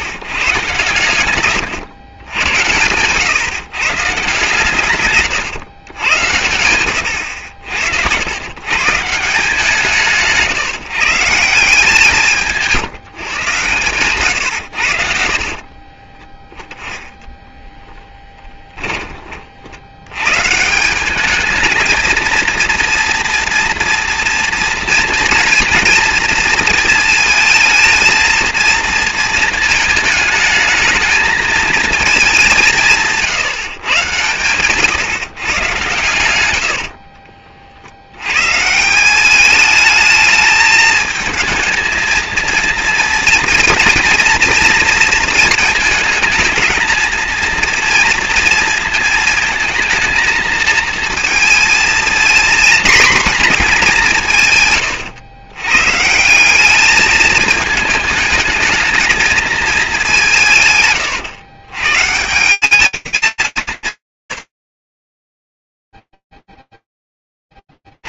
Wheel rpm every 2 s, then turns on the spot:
130, 100, 130, 110, 140, 140, 160, 90, 10, 20, 170, 230, 230, 230, 230, 220, 180, 120, 80, 150, 220, 240, 230, 220, 230, 220, 240, 140, 200, 220, 160, 200, 60, 0.
14-16 36-38